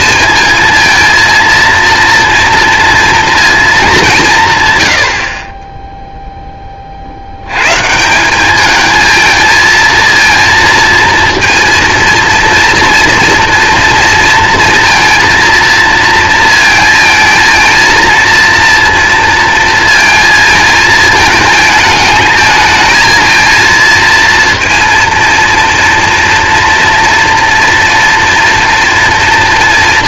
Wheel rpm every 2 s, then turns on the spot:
230, 230, 120, 30, 210, 230, 230, 230, 220, 230, 220, 220, 230, 230, 230.
none